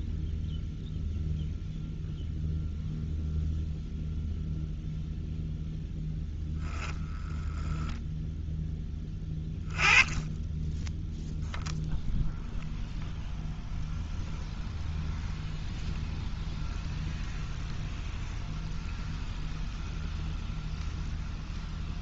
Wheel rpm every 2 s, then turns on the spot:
0, 0, 0, 0, 10, 10, 0, 0, 0, 0, 0.
none